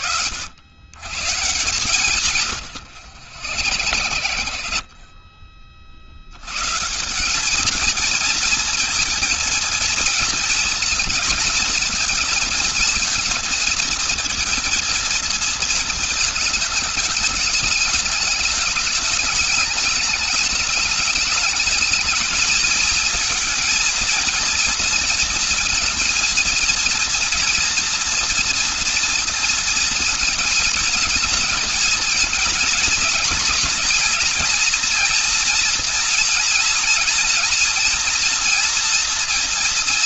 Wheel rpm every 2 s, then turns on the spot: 120, 120, 70, 110, 220, 220, 220, 230, 220, 220, 210, 220, 230, 230, 230, 220, 230, 240, 230, 230.
2-6